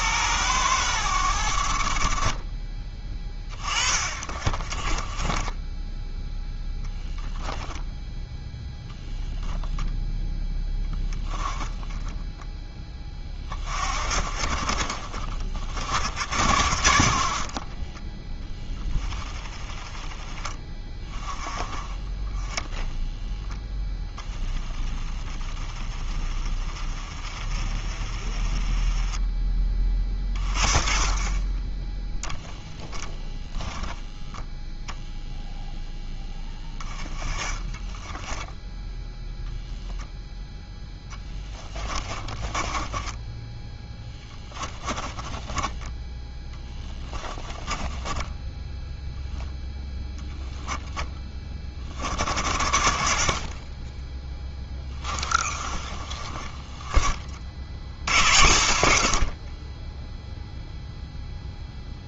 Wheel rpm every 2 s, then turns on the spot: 90, 20, 20, 0, 0, 10, 10, 40, 60, 10, 20, 0, 10, 20, 20, 10, 10, 0, 20, 10, 10, 10, 10, 10, 0, 20, 60, 10, 20, 70, 0.
2-6 32-34 36-38 42-48